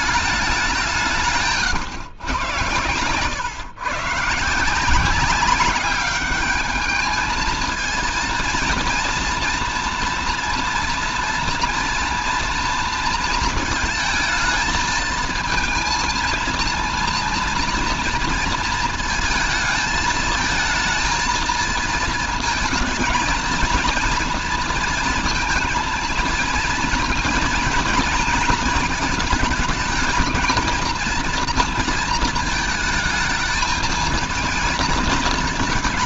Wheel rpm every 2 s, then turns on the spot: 190, 120, 170, 210, 230, 230, 230, 220, 230, 220, 220, 220, 230, 230, 220, 230, 230, 230.
none